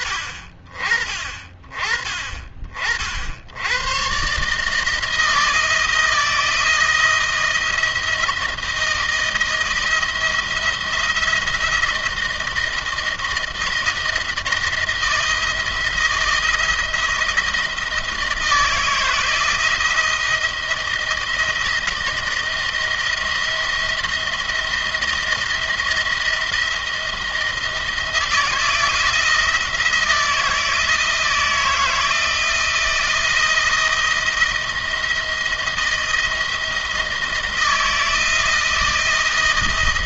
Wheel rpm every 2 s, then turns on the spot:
30, 40, 150, 160, 160, 170, 160, 170, 170, 160, 170, 170, 170, 170, 170, 160, 160, 170, 160, 160.
none